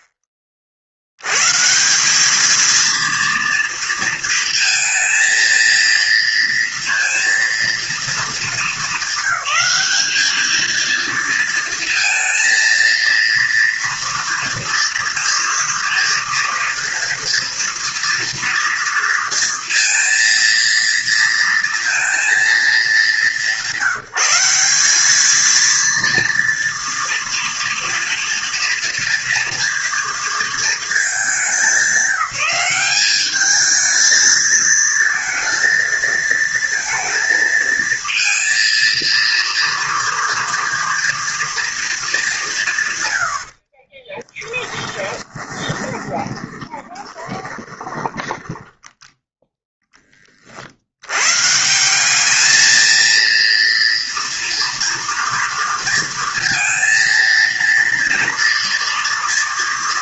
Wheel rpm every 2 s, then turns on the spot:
50, 220, 230, 230, 210, 220, 230, 230, 230, 230, 230, 220, 180, 230, 230, 230, 190, 220, 230, 230, 230, 160, 10, 20, 10, 40, 220, 230, 230, 230.
44-48